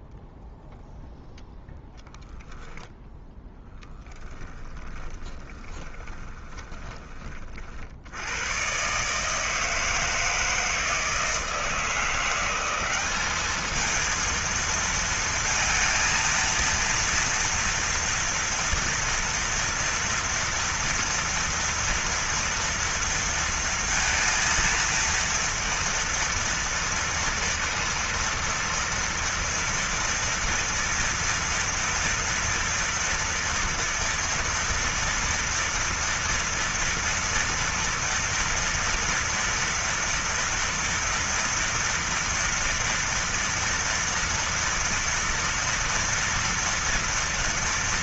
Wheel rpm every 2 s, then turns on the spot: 0, 0, 10, 20, 120, 160, 180, 230, 230, 230, 230, 230, 230, 230, 230, 230, 230, 230, 230, 230, 240, 240, 230, 240.
4-8